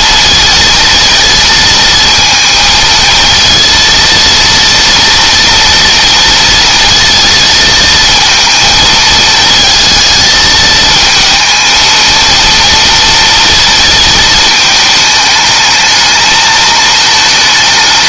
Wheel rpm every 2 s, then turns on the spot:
230, 220, 230, 230, 220, 220, 230, 220, 220.
none